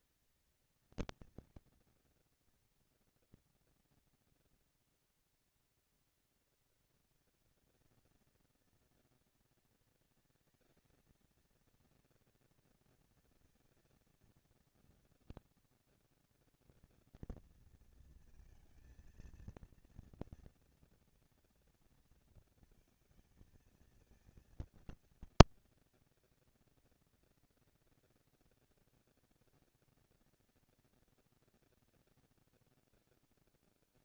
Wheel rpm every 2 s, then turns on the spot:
220, 240, 230, 230, 230, 230, 230, 230, 230, 230, 230, 230, 220, 200, 200, 230, 140.
none